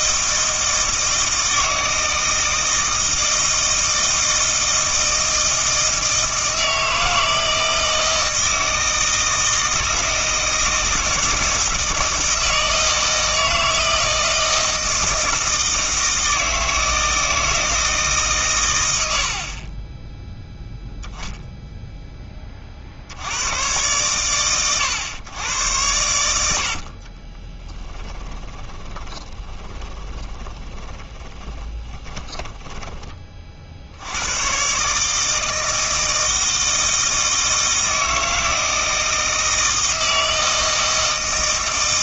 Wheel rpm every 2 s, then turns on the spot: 160, 160, 160, 160, 160, 160, 160, 160, 160, 110, 0, 50, 100, 60, 30, 20, 20, 140, 160, 160, 160.
26-34